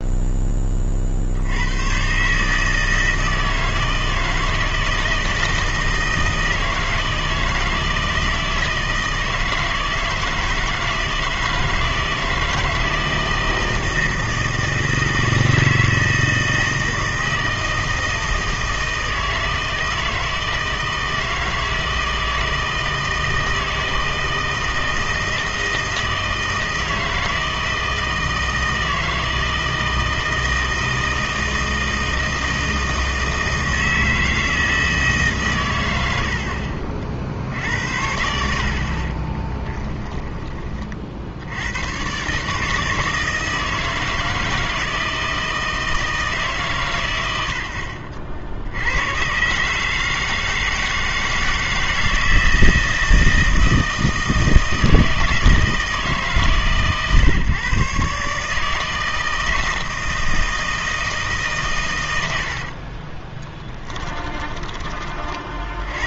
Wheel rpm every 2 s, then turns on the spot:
40, 160, 160, 160, 160, 160, 160, 160, 160, 160, 160, 160, 160, 160, 160, 160, 160, 160, 40, 50, 30, 150, 160, 130, 80, 160, 160, 160, 130, 160, 160, 40, 20.
36-38 62-64